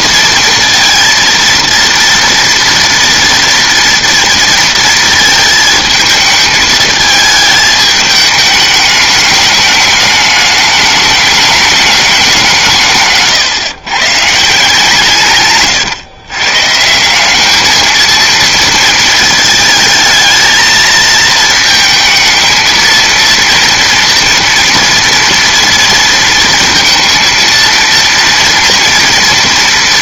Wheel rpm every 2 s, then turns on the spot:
230, 240, 230, 220, 210, 210, 170, 150, 150, 230, 220, 230, 230, 230, 230.
none